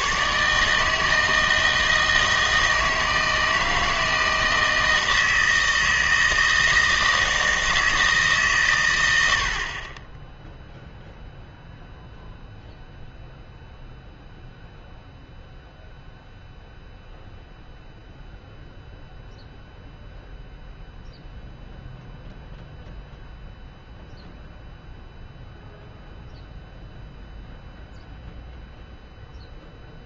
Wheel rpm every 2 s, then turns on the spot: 150, 160, 160, 160, 130, 0, 0, 0, 0, 0, 0, 0, 0, 0, 0.
none